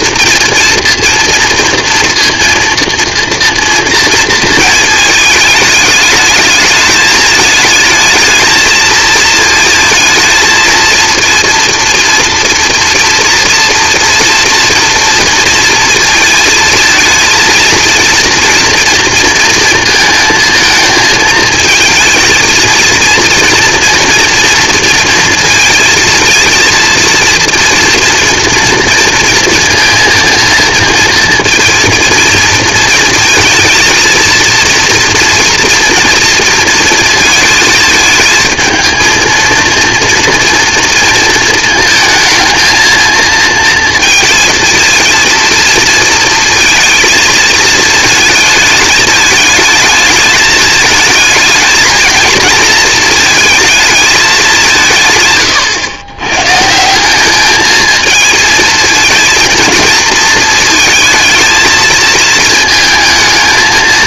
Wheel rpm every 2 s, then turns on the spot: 230, 230, 220, 220, 220, 230, 230, 230, 220, 230, 230, 230, 230, 220, 230, 230, 220, 230, 230, 230, 230, 230, 220, 230, 220, 220, 220, 170, 150, 220, 220, 230.
none